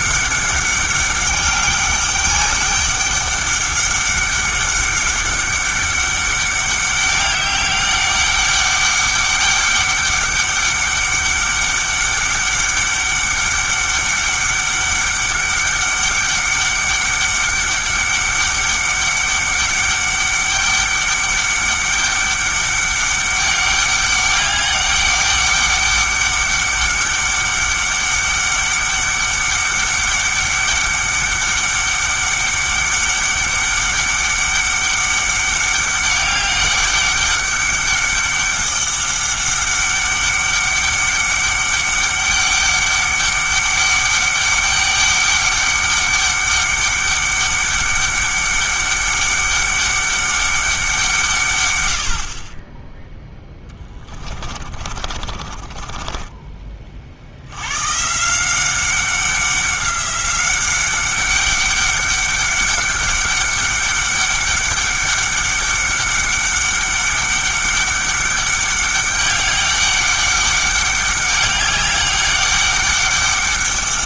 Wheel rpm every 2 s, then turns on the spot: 200, 200, 200, 200, 200, 200, 200, 200, 200, 200, 200, 200, 200, 200, 200, 200, 200, 200, 200, 200, 200, 200, 200, 200, 200, 190, 20, 30, 30, 190, 190, 200, 200, 200, 200, 200, 200.
54-56